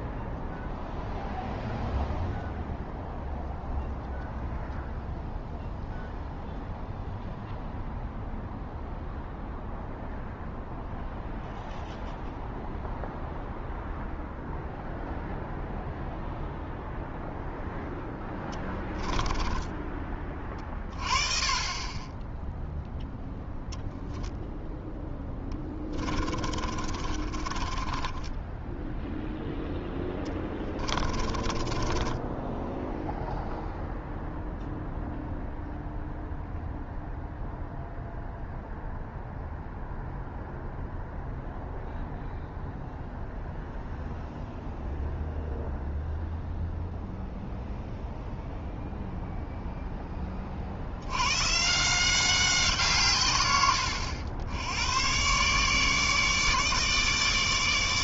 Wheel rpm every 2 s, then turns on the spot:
0, 0, 0, 0, 0, 0, 0, 0, 0, 10, 30, 0, 10, 40, 0, 30, 0, 0, 0, 0, 0, 0, 0, 0, 0, 120, 130, 120, 150.
18-20 24-28 30-32